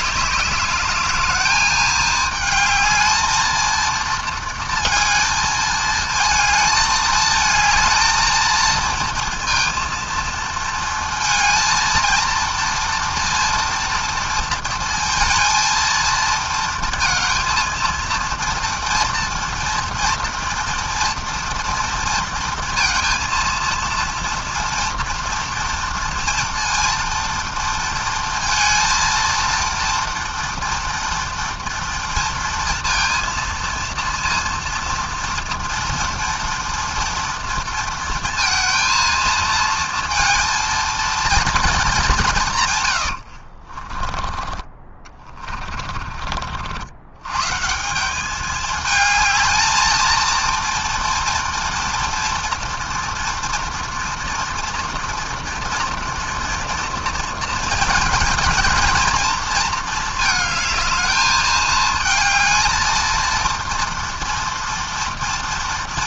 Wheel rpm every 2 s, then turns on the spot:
210, 220, 220, 220, 230, 230, 240, 230, 230, 230, 230, 230, 230, 230, 230, 230, 230, 230, 230, 230, 230, 80, 30, 120, 220, 240, 230, 230, 230, 230, 220, 230, 230.
42-46